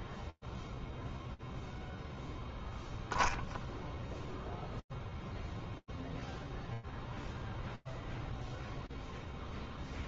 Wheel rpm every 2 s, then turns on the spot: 0, 0, 0, 0, 40.
none